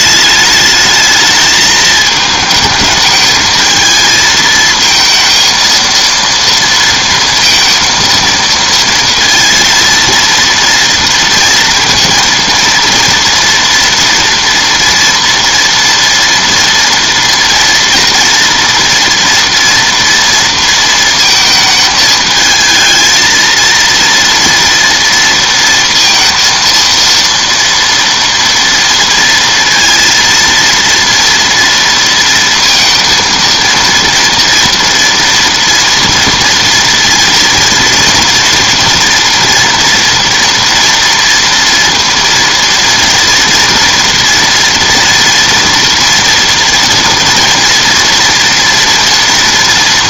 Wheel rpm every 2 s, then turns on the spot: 210, 220, 220, 230, 230, 230, 230, 230, 230, 240, 230, 220, 230, 230, 230, 230, 230, 230, 230, 230, 230, 230, 230, 230, 230.
none